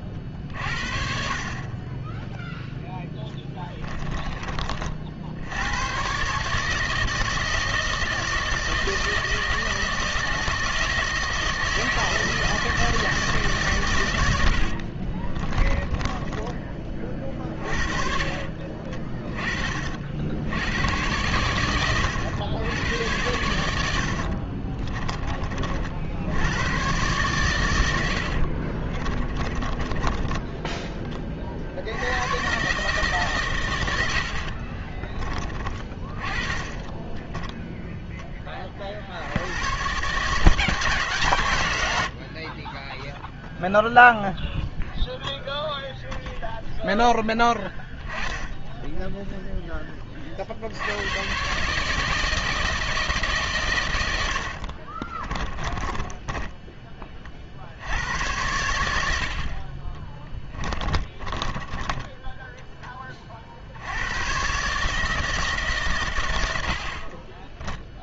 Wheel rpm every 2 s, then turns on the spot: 50, 0, 40, 150, 160, 160, 160, 70, 20, 40, 80, 100, 40, 110, 50, 10, 140, 50, 30, 30, 160, 30, 0, 0, 10, 80, 160, 60, 10, 90, 20, 10, 140, 80.
14-16 18-20 24-26 28-32 34-38 54-56 60-62